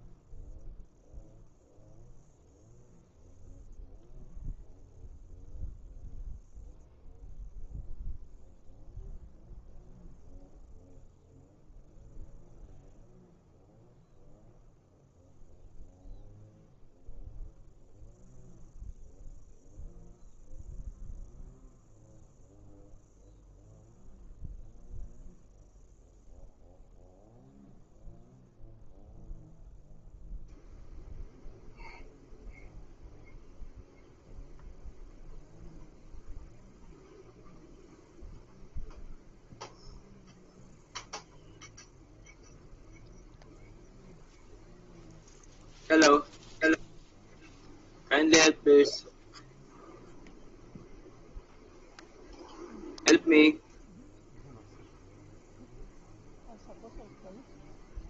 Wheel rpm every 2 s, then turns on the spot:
0, 0, 0, 0, 0, 0, 0, 0, 0, 0, 0, 0, 0, 0, 0, 0, 0, 0, 0, 0, 0, 0, 0, 0, 0, 0, 0, 0, 0.
none